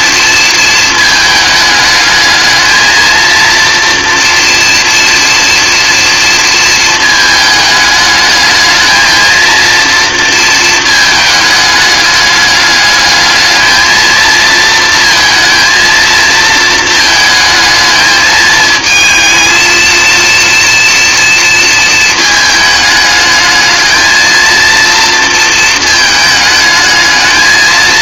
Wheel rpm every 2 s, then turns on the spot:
210, 230, 230, 210, 230, 210, 220, 230, 220, 230, 230, 220, 220, 230.
none